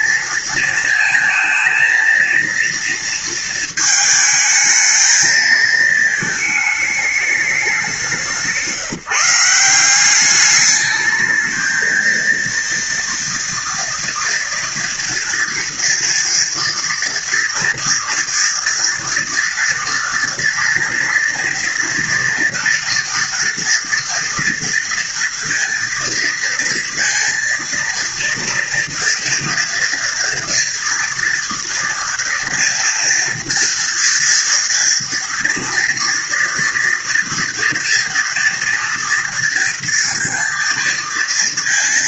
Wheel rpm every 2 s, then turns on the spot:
230, 230, 220, 210, 160, 210, 230, 240, 230, 230, 230, 230, 230, 230, 230, 240, 230, 230, 230, 240, 230.
none